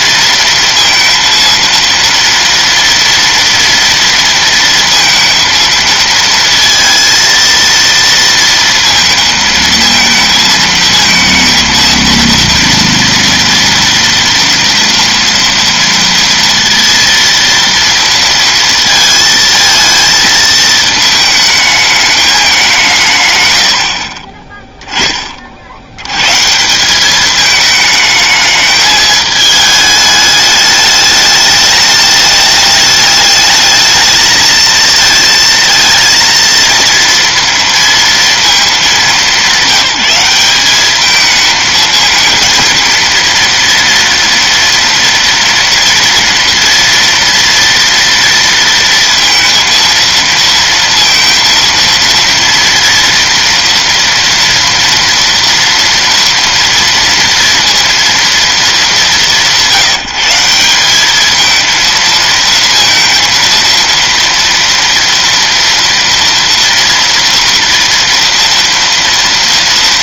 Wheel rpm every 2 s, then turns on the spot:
230, 230, 230, 230, 230, 230, 230, 230, 230, 230, 220, 190, 20, 160, 210, 210, 210, 220, 230, 220, 200, 230, 230, 230, 230, 230, 230, 240, 230, 220, 180, 230, 230, 230, 230.
none